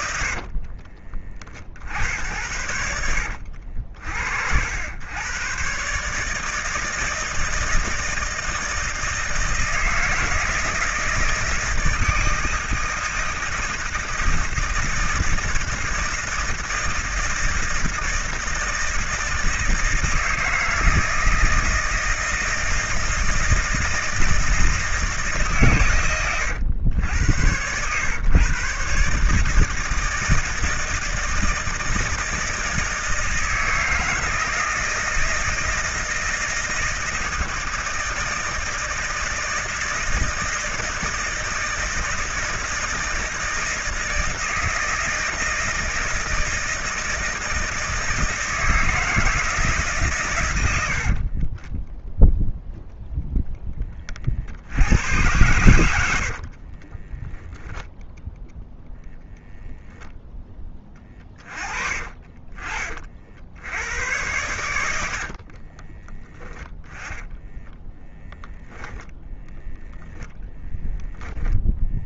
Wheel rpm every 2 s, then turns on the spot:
50, 70, 70, 160, 160, 160, 160, 160, 160, 160, 160, 160, 160, 90, 120, 160, 160, 160, 160, 160, 160, 160, 160, 160, 160, 90, 0, 70, 50, 10, 20, 30, 100, 20, 10, 0.
0-2 56-58 60-62 66-70